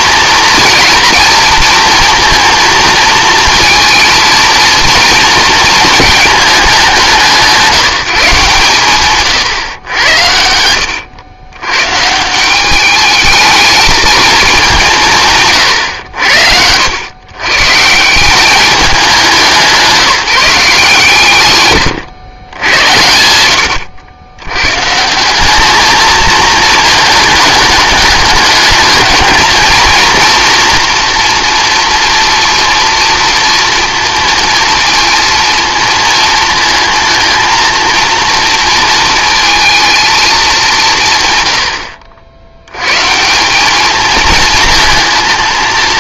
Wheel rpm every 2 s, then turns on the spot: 230, 230, 230, 210, 140, 80, 190, 200, 80, 200, 160, 90, 120, 220, 210, 230, 240, 230, 220, 230, 180, 90, 220.
none